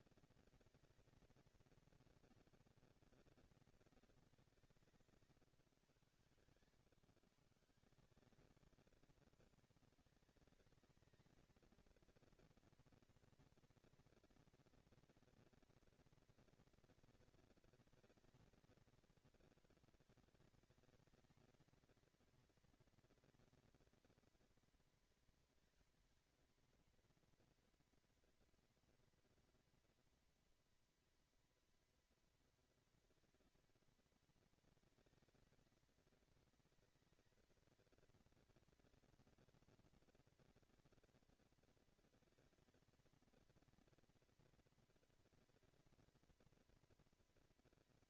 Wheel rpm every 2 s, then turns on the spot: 220, 220, 180, 120, 190, 210, 230, 230, 230, 230, 220, 230, 230, 220, 230, 230, 230, 230, 220, 230, 240, 230, 240, 230.
none